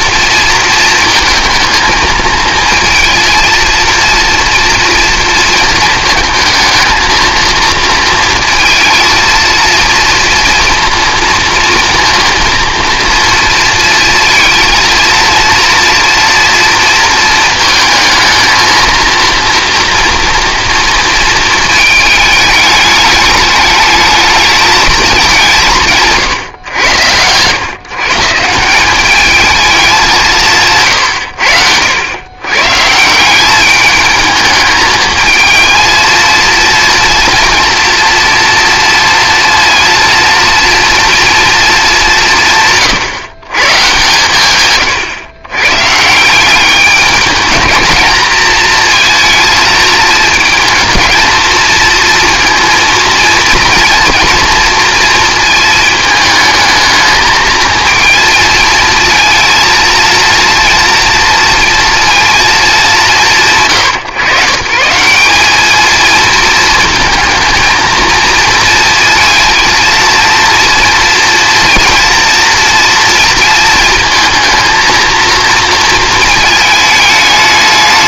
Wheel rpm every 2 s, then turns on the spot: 230, 230, 230, 220, 230, 230, 230, 230, 230, 230, 230, 210, 220, 110, 180, 150, 140, 220, 230, 240, 230, 130, 130, 200, 220, 220, 230, 230, 220, 230, 230, 190, 150, 230, 230, 230, 230, 230, 220.
none